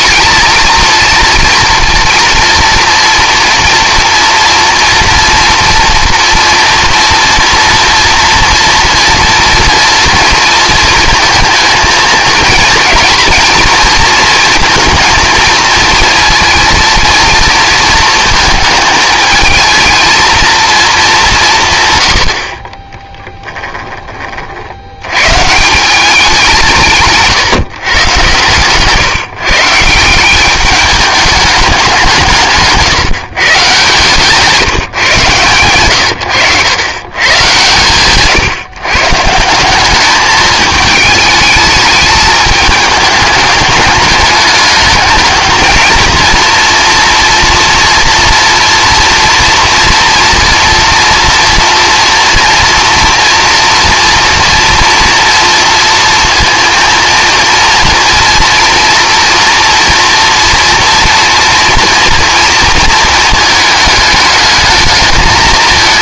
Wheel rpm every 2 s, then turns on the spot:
230, 230, 230, 230, 230, 230, 220, 230, 230, 220, 230, 50, 70, 170, 130, 200, 150, 160, 110, 130, 210, 220, 210, 240, 230, 230, 230, 230, 230, 230, 230, 230, 210.
none